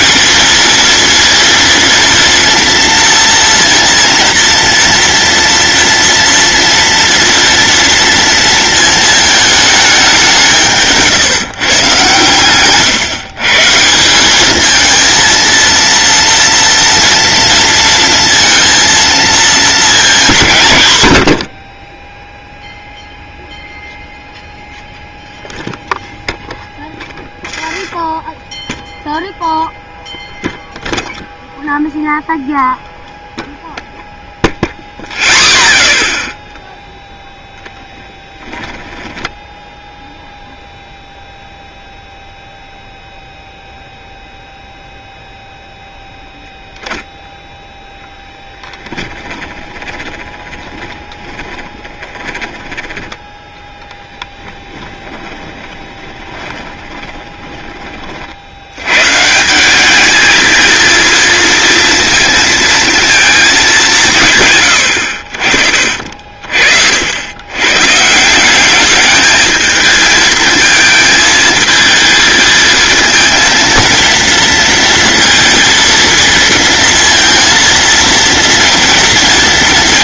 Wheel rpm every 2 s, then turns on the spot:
230, 230, 230, 230, 220, 160, 130, 220, 230, 230, 110, 0, 0, 10, 0, 0, 0, 0, 0, 10, 0, 0, 0, 0, 10, 20, 10, 10, 20, 110, 230, 230, 100, 60, 210, 220, 220, 230, 230, 230.
26-28 38-40 48-52 54-58